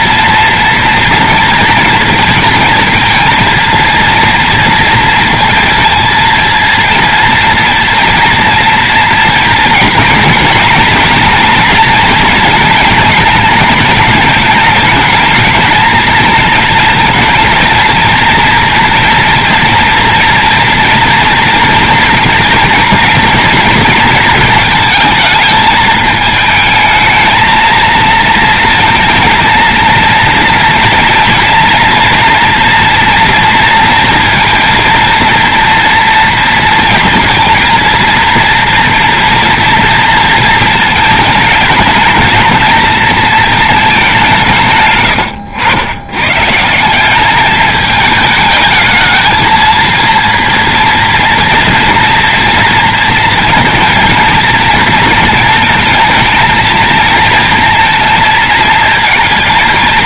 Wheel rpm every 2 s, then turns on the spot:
230, 230, 230, 230, 230, 240, 230, 220, 220, 230, 230, 230, 220, 220, 230, 230, 230, 230, 230, 230, 230, 230, 150, 160, 220, 230, 230, 230, 220, 230.
none